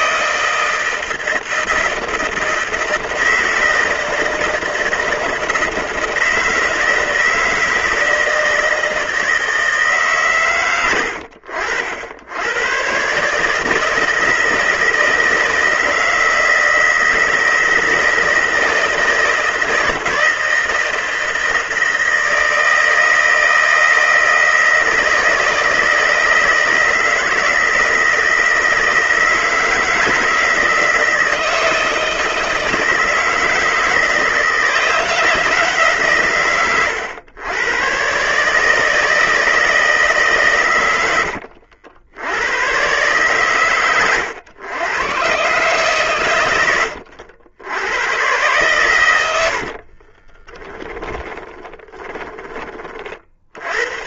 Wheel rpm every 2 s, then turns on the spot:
160, 160, 160, 160, 160, 120, 110, 160, 160, 160, 160, 160, 160, 160, 160, 160, 160, 160, 120, 150, 130, 110, 110, 110, 110, 20, 20.
50-52